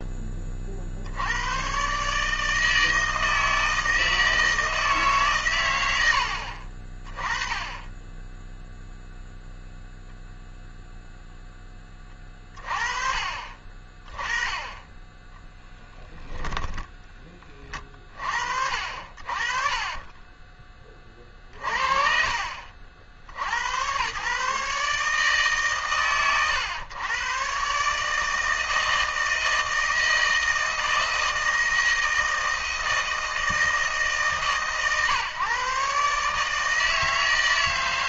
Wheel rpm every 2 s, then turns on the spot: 50, 160, 160, 40, 0, 0, 30, 20, 10, 60, 10, 50, 140, 120, 160, 160, 160, 130, 160.
16-18